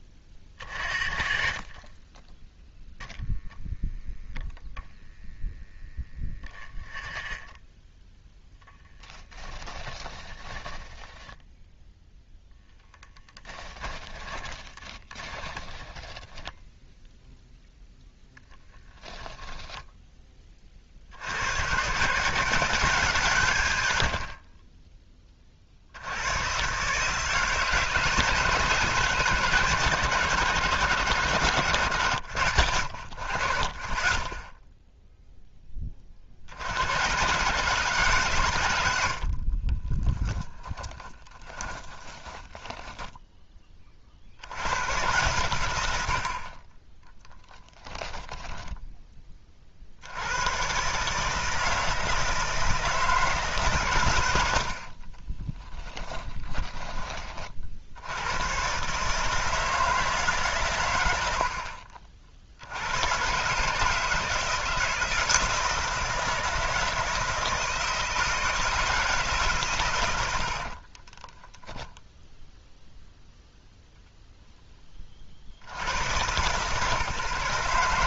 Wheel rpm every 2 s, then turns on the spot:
40, 0, 0, 10, 10, 10, 10, 20, 10, 10, 50, 170, 20, 140, 160, 110, 90, 0, 80, 110, 10, 10, 110, 20, 10, 130, 160, 60, 20, 140, 120, 90, 160, 160, 160, 40, 0, 10, 140.
6-12 14-16 18-20 40-44 54-56 70-72